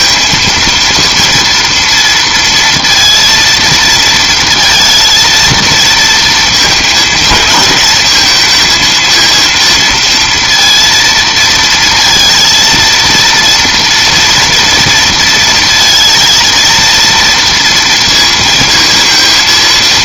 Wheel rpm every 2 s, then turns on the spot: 230, 230, 230, 220, 220, 230, 230, 230, 230, 230.
none